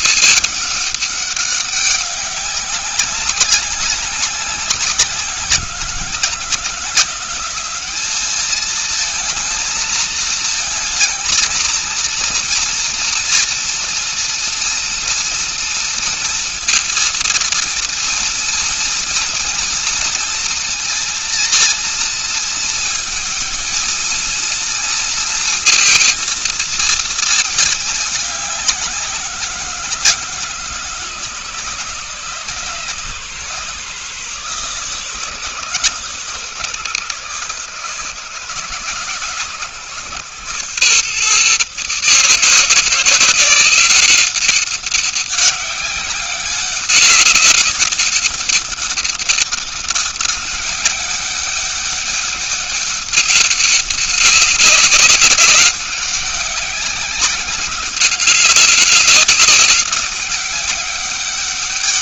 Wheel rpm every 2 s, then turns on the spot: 210, 200, 190, 170, 210, 230, 230, 230, 230, 230, 230, 220, 230, 230, 200, 160, 150, 140, 140, 140, 130, 160, 190, 200, 200, 200, 200, 190, 200, 190, 200.
none